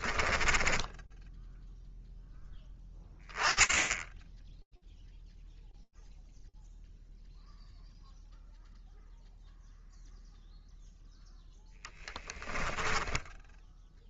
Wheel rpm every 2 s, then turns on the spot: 0, 10, 0, 0, 0, 0, 10.
12-14